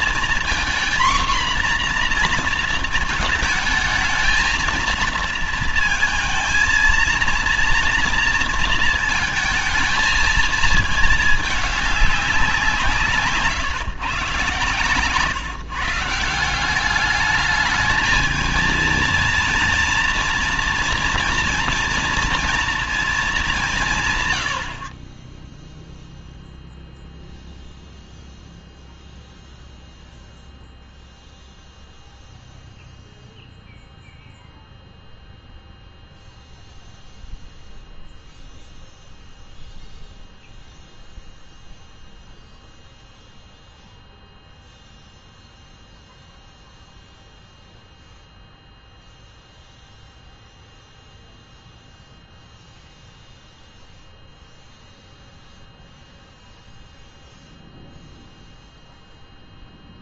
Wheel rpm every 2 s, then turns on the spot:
240, 230, 220, 230, 230, 220, 180, 130, 190, 220, 230, 230, 80, 0, 0, 0, 0, 0, 0, 0, 0, 0, 0, 0, 0, 0, 0, 0, 0, 0.
none